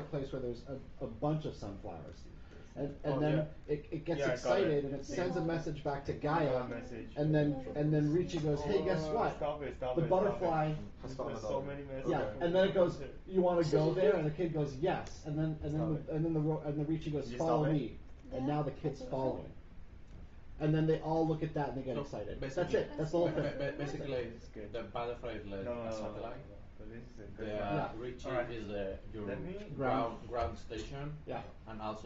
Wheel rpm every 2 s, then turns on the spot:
0, 0, 0, 0, 0, 0, 0, 0, 0, 0, 0, 0, 0, 0, 0, 0.
none